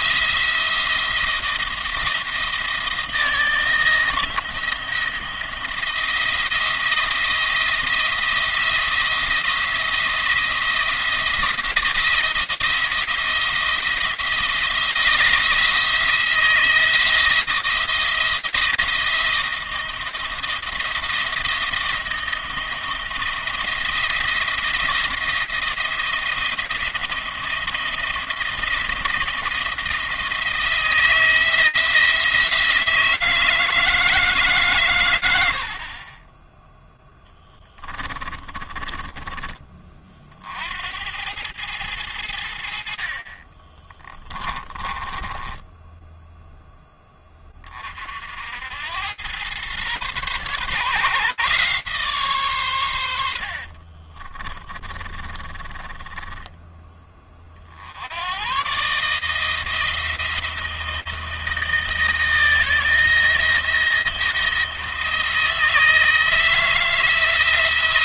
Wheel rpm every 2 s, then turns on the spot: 170, 170, 170, 170, 170, 170, 160, 160, 160, 170, 170, 170, 170, 170, 170, 160, 160, 130, 10, 20, 80, 60, 20, 10, 90, 130, 100, 30, 20, 140, 160, 160, 160, 160.
38-40 44-46 54-56